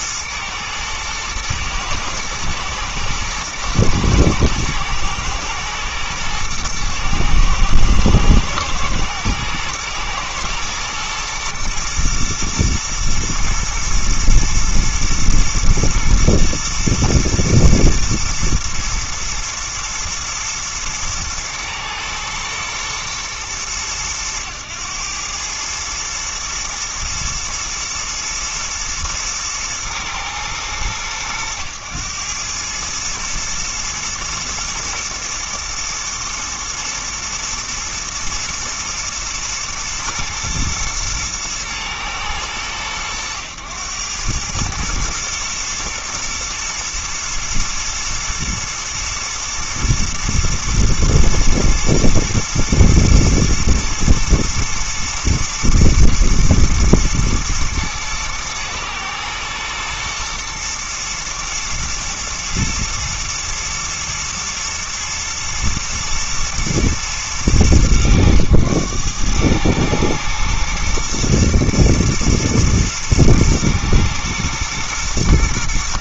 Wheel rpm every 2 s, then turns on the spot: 110, 120, 120, 110, 120, 120, 120, 110, 120, 110, 110, 110, 100, 110, 110, 110, 100, 120, 110, 110, 110, 110, 110, 110, 120, 120, 110, 120, 110, 110, 120, 110, 120, 110, 110, 110, 110, 110.
none